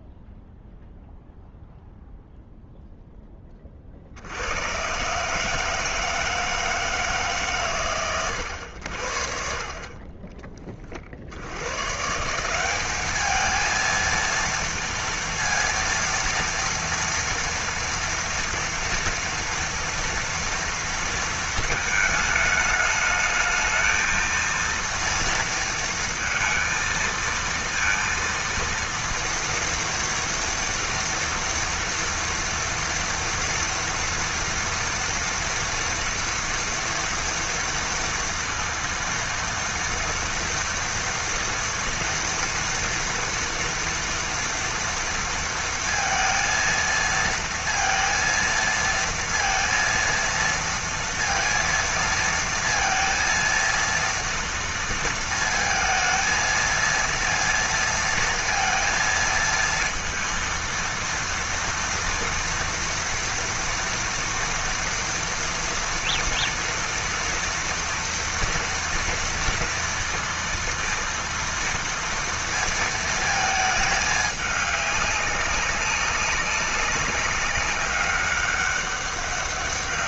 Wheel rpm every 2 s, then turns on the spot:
0, 0, 70, 160, 100, 20, 170, 230, 230, 230, 230, 220, 230, 230, 230, 230, 230, 230, 240, 230, 230, 240, 230, 230, 230, 230, 230, 230, 230, 230, 230, 230, 230, 240, 230, 230, 230, 210, 200, 200.
none